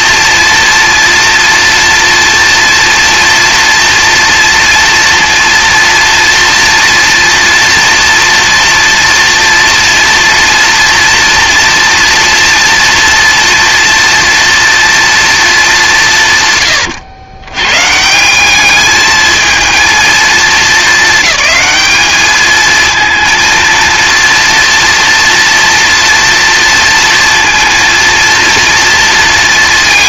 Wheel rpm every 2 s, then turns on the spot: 230, 230, 230, 230, 230, 230, 230, 230, 120, 210, 220, 220, 230, 230, 230.
none